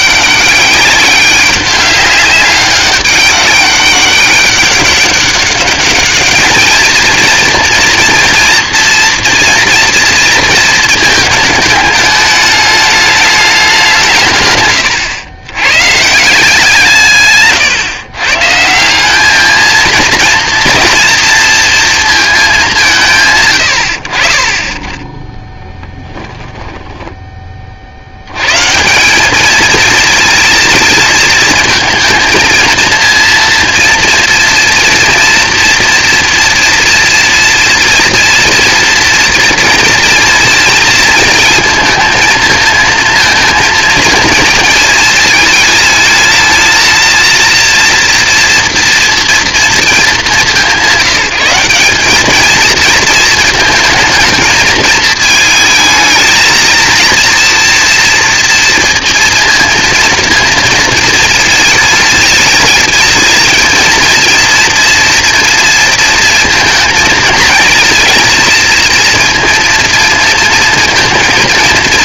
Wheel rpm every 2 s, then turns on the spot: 200, 200, 200, 220, 230, 230, 210, 120, 170, 160, 240, 190, 20, 10, 140, 220, 230, 240, 240, 230, 230, 220, 220, 230, 230, 190, 220, 220, 230, 230, 230, 230, 230, 220, 230, 230.
14-16 26-28